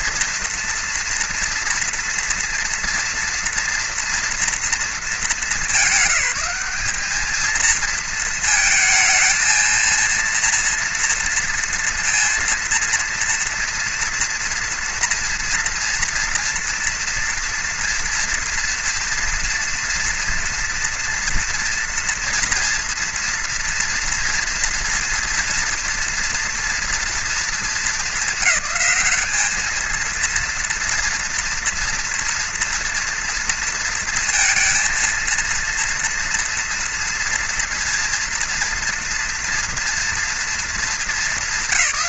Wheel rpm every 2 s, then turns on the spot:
230, 230, 230, 200, 220, 230, 230, 230, 230, 230, 230, 230, 230, 230, 210, 230, 230, 230, 230, 230, 220.
none